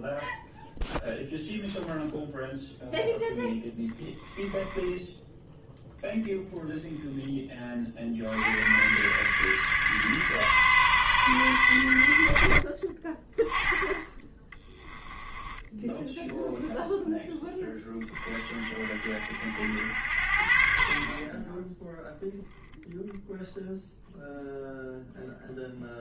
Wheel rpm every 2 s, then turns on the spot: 0, 0, 10, 0, 110, 140, 50, 10, 0, 40, 40, 0, 0.
4-6 12-16